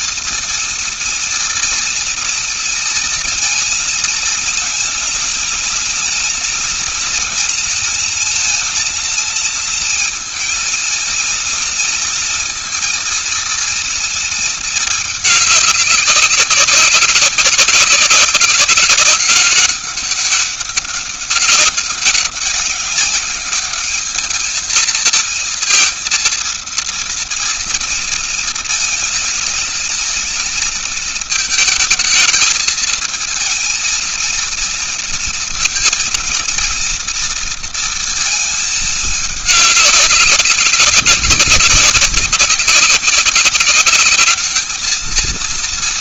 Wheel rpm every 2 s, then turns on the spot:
230, 230, 230, 230, 230, 230, 230, 220, 190, 190, 200, 200, 220, 230, 230, 230, 220, 230, 230, 220, 200, 190, 210.
none